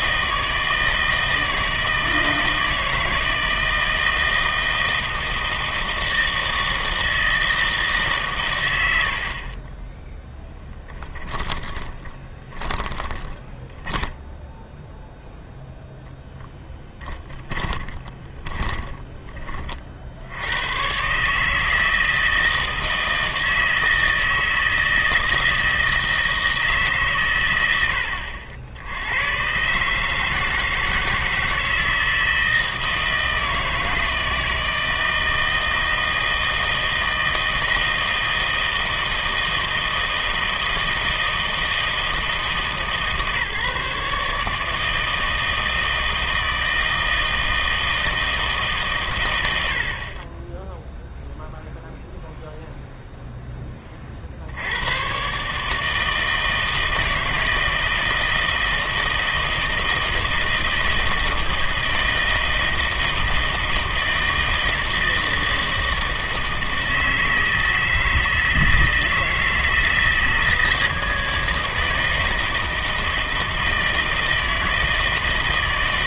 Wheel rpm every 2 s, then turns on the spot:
160, 160, 160, 160, 100, 10, 10, 0, 10, 20, 110, 160, 160, 150, 70, 160, 160, 160, 160, 160, 160, 150, 160, 160, 140, 10, 0, 90, 160, 160, 160, 160, 160, 160, 160, 160, 160, 160.
10-14 18-20